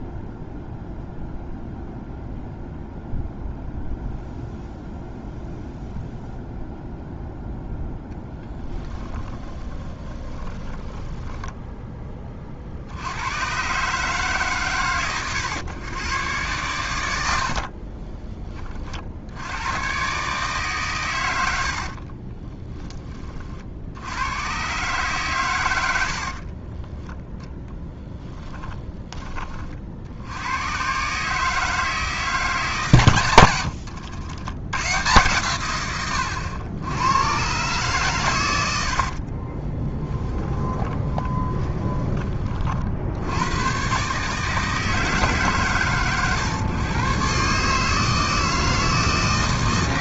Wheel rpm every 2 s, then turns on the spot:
0, 0, 0, 0, 10, 10, 70, 120, 100, 50, 130, 20, 120, 10, 10, 130, 140, 110, 100, 80, 20, 50, 150, 120, 160.
8-12 26-28 40-42